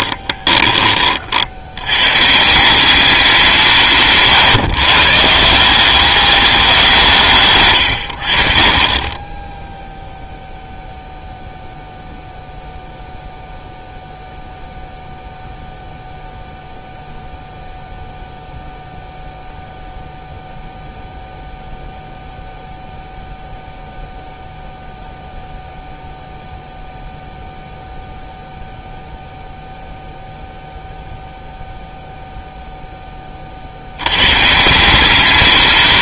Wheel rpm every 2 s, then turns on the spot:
20, 180, 130, 190, 50, 0, 0, 0, 0, 0, 0, 0, 0, 0, 0, 0, 0, 150.
none